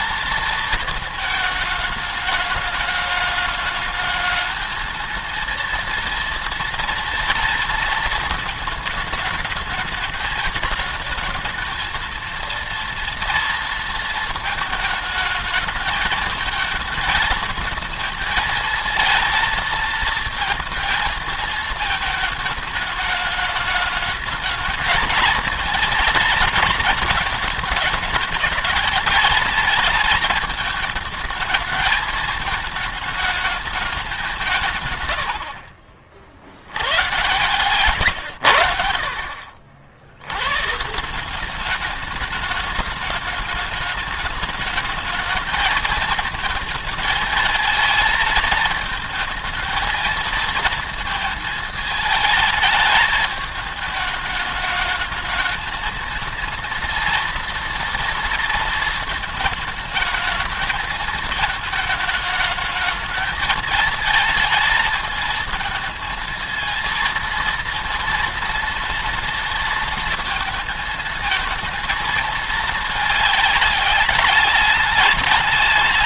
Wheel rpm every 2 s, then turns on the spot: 220, 210, 220, 230, 220, 220, 230, 230, 220, 220, 220, 210, 220, 230, 220, 220, 210, 170, 70, 90, 110, 210, 210, 220, 220, 230, 220, 220, 230, 230, 220, 220, 220, 220, 230, 230, 220, 210.
none